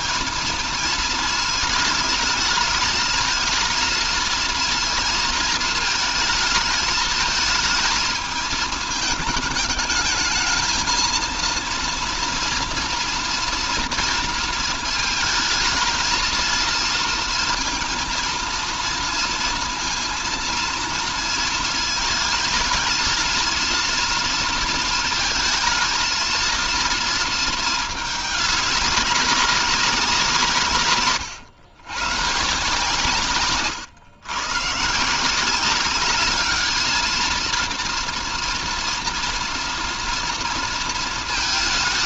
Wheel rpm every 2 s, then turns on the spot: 220, 220, 230, 220, 220, 230, 230, 220, 230, 230, 230, 230, 220, 220, 200, 140, 140, 160, 220, 230, 230.
none